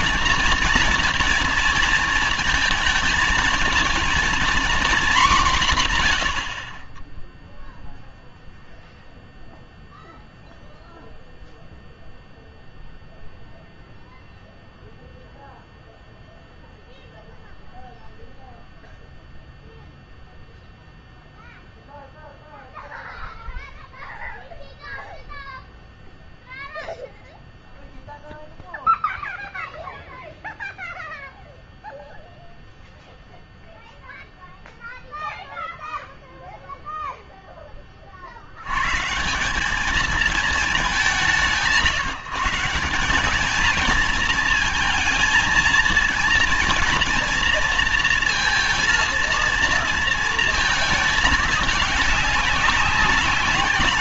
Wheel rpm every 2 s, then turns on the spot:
230, 220, 240, 60, 0, 0, 0, 0, 0, 0, 0, 0, 0, 0, 0, 0, 0, 0, 0, 80, 210, 170, 230, 230, 230, 220, 200.
none